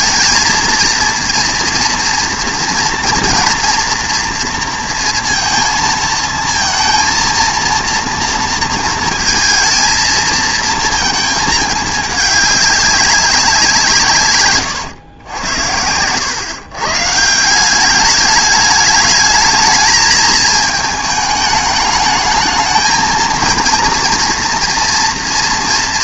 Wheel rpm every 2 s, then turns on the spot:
230, 240, 230, 230, 230, 230, 200, 110, 130, 210, 220, 220, 230.
none